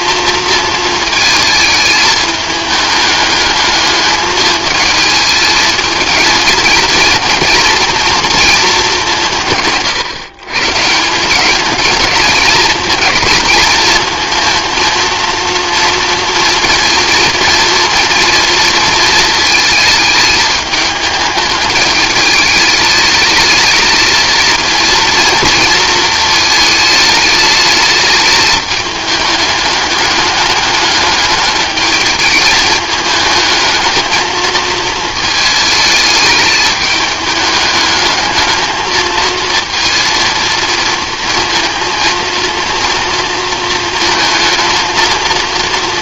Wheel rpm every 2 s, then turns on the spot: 230, 220, 220, 220, 230, 140, 210, 230, 230, 220, 210, 210, 230, 220, 210, 210, 220, 220, 210, 220, 220, 230, 230.
none